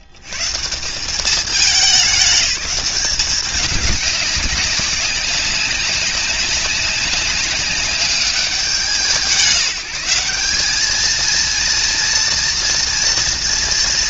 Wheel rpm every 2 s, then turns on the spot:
130, 200, 200, 200, 180, 180, 230.
none